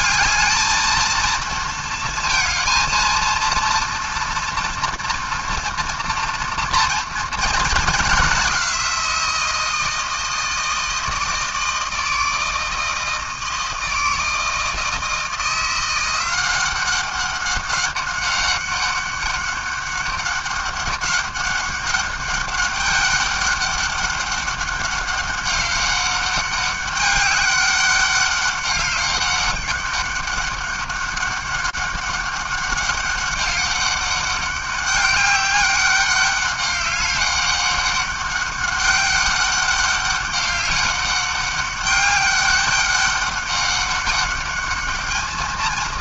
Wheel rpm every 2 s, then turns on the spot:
220, 230, 230, 230, 200, 160, 160, 160, 180, 200, 200, 200, 200, 200, 200, 200, 200, 200, 200, 200, 200, 200, 210.
none